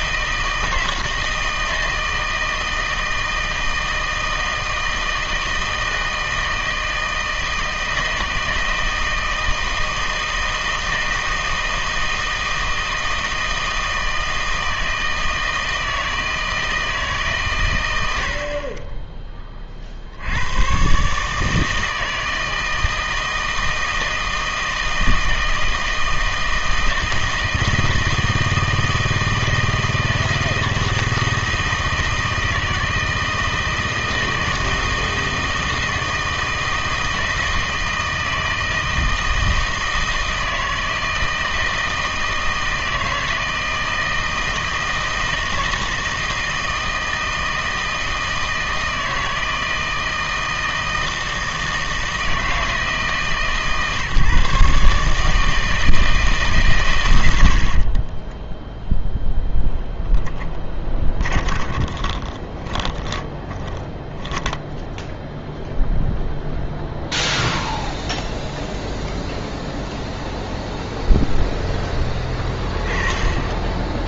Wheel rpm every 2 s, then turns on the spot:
160, 160, 160, 160, 160, 160, 160, 160, 160, 30, 120, 160, 160, 160, 160, 160, 160, 160, 160, 160, 160, 160, 160, 160, 160, 160, 160, 140, 130, 0, 20, 20, 10, 0, 0, 0, 20.
60-64